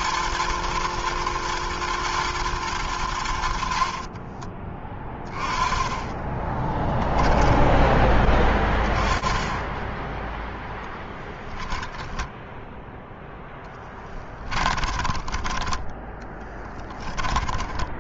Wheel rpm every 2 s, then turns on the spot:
120, 120, 30, 20, 10, 10, 0, 20, 10.
4-8 14-18